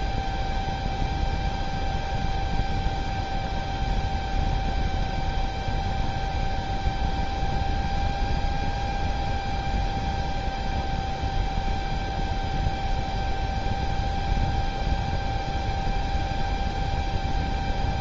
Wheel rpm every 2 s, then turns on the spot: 0, 0, 0, 0, 0, 0, 0, 0, 0.
none